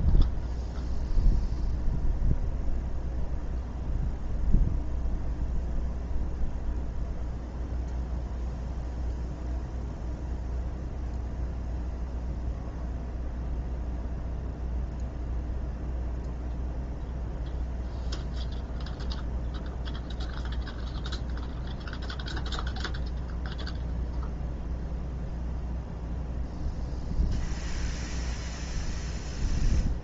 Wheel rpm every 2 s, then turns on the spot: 0, 0, 0, 0, 0, 0, 0, 0, 0, 0, 0, 0, 0, 0, 0.
none